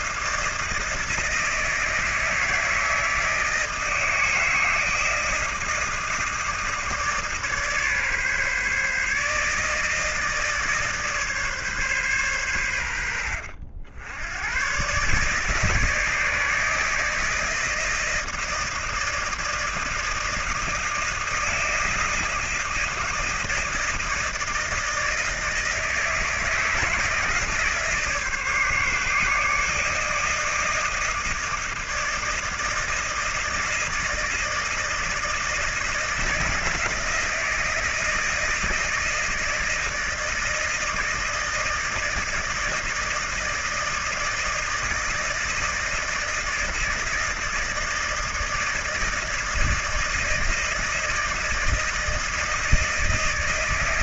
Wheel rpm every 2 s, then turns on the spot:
160, 160, 160, 160, 140, 150, 110, 110, 160, 160, 160, 160, 160, 160, 150, 160, 160, 160, 160, 160, 160, 160, 160, 160, 160, 160, 160.
none